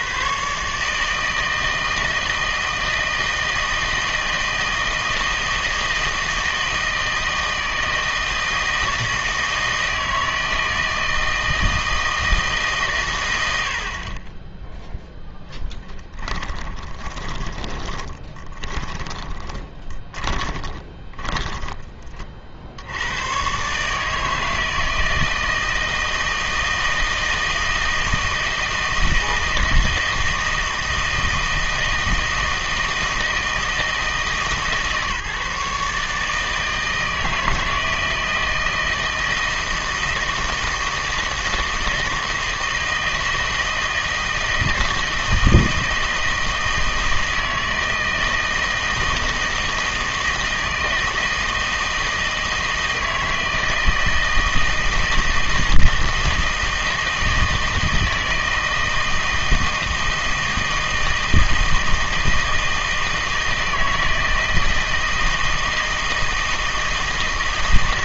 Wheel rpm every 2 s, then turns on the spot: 140, 160, 160, 160, 160, 160, 150, 10, 10, 20, 20, 50, 160, 160, 160, 160, 160, 150, 160, 160, 160, 160, 160, 160, 160, 160, 160, 160, 160, 160, 160, 160, 160, 160.
16-22